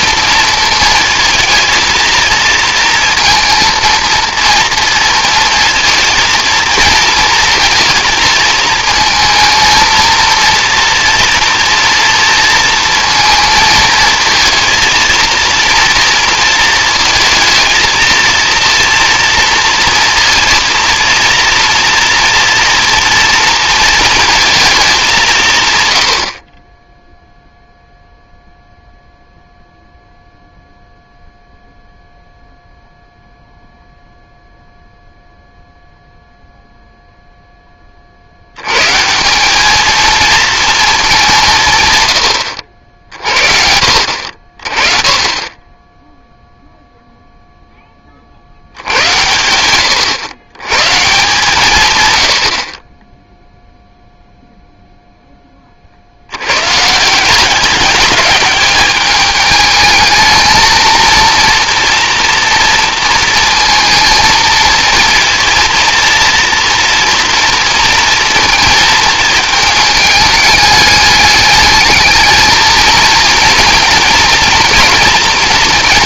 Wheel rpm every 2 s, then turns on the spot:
220, 230, 230, 230, 220, 230, 230, 230, 220, 230, 230, 230, 200, 20, 0, 0, 0, 0, 0, 130, 220, 50, 30, 0, 90, 140, 30, 0, 130, 210, 230, 230, 230, 230, 220, 210, 220, 230.
none